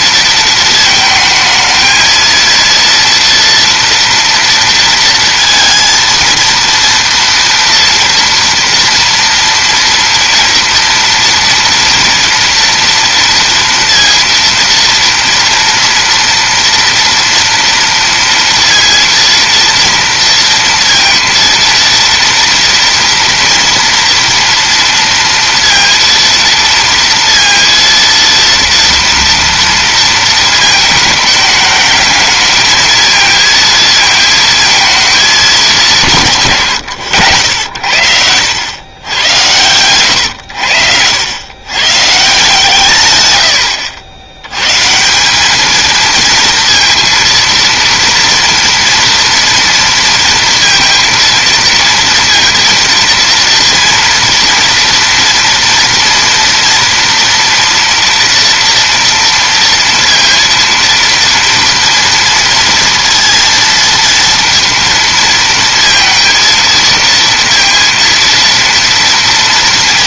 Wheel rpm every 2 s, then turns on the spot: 220, 230, 230, 230, 230, 230, 240, 230, 230, 230, 230, 230, 230, 230, 230, 220, 220, 230, 150, 100, 100, 130, 130, 230, 230, 230, 230, 230, 230, 230, 230, 230, 230, 230, 230.
none